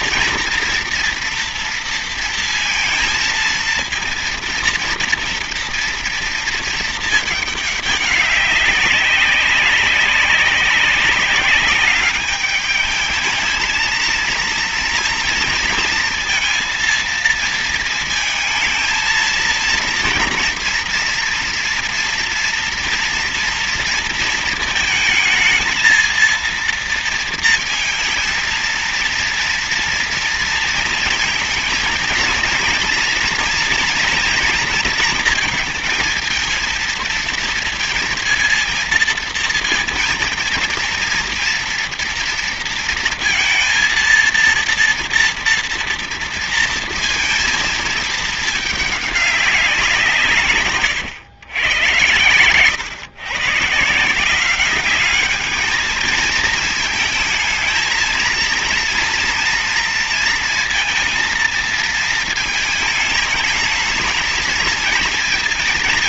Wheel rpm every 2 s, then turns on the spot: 230, 230, 230, 230, 200, 190, 210, 230, 230, 220, 240, 230, 230, 230, 230, 230, 230, 240, 220, 230, 230, 230, 230, 230, 220, 140, 130, 190, 220, 230, 230, 220, 230.
50-52